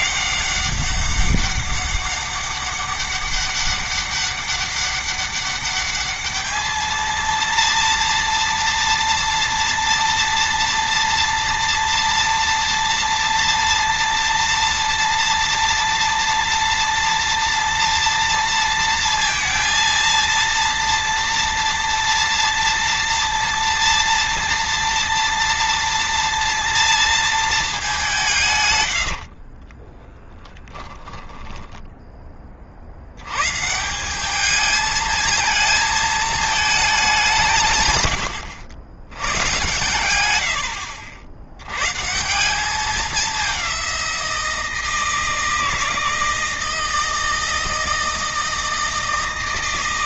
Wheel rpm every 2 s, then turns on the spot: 200, 200, 200, 220, 230, 230, 230, 230, 230, 230, 230, 230, 230, 230, 140, 10, 30, 210, 220, 100, 100, 200, 170, 160, 160.
28-32